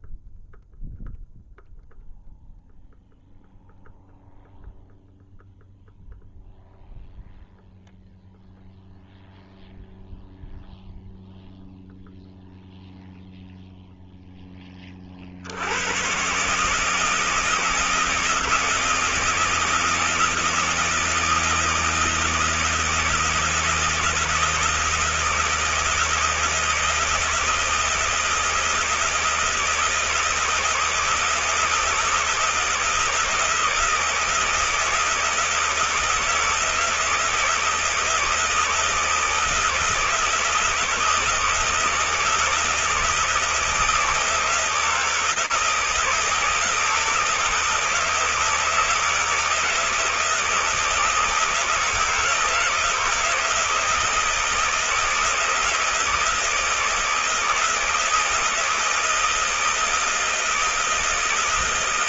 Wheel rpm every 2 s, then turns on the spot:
0, 0, 0, 0, 0, 0, 0, 10, 150, 160, 160, 160, 160, 160, 160, 160, 160, 160, 160, 160, 170, 160, 160, 160, 160, 160, 160, 160, 160, 170, 160.
none